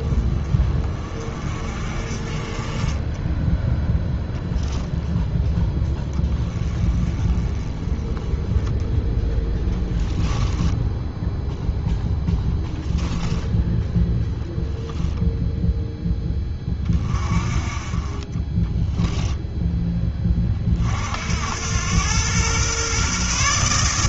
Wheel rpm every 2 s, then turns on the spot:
30, 20, 10, 20, 10, 10, 10, 0, 20, 10, 50, 130.
10-14 18-20